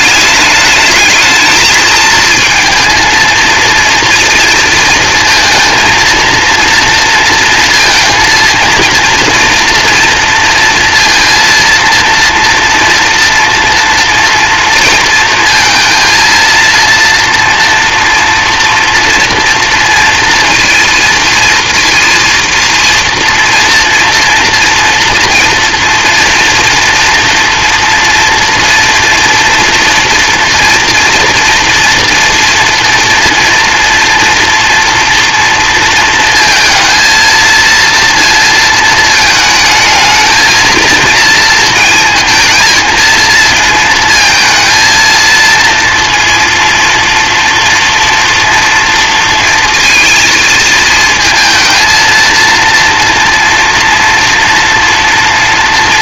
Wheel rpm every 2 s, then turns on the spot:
210, 220, 230, 230, 230, 230, 230, 230, 230, 240, 230, 230, 230, 230, 230, 230, 230, 230, 230, 220, 220, 220, 220, 230, 230, 220, 230, 230.
none